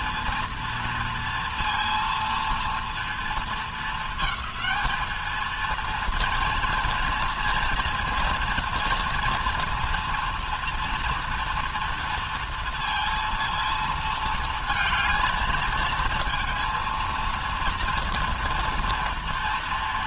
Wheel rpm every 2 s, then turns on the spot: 230, 230, 220, 230, 230, 230, 230, 220, 230, 230.
none